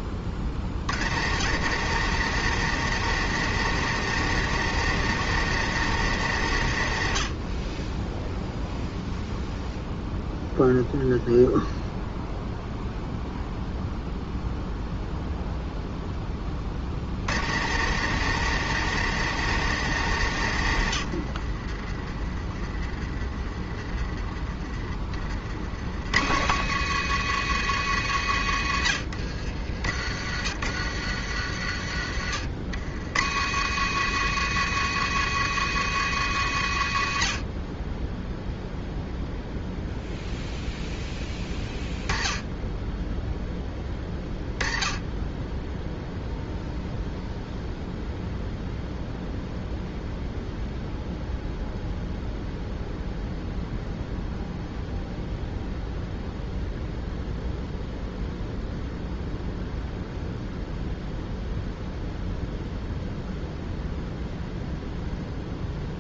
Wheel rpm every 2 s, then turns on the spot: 110, 170, 170, 80, 0, 0, 0, 0, 90, 170, 80, 30, 40, 160, 70, 90, 110, 150, 80, 0, 10, 10, 10, 0, 0, 0, 0, 0, 0, 0, 0, 0, 0.
none